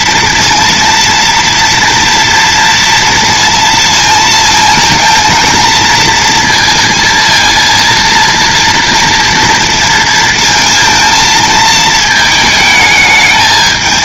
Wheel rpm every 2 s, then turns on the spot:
230, 230, 230, 230, 230, 230, 220.
none